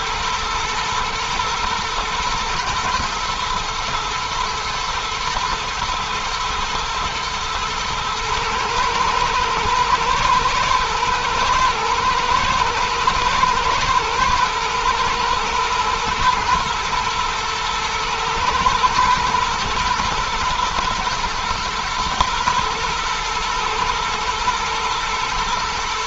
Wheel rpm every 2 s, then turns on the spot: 110, 120, 120, 120, 110, 120, 120, 110, 110, 110, 110, 120, 120.
none